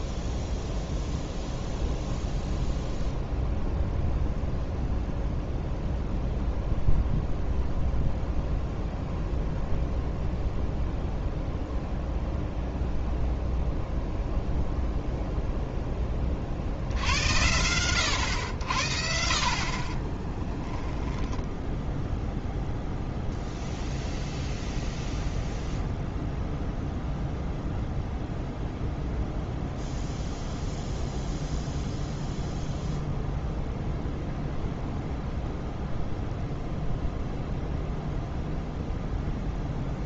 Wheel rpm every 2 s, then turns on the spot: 0, 0, 0, 0, 0, 0, 0, 0, 60, 80, 10, 0, 0, 0, 0, 0, 0, 0, 0, 0.
20-22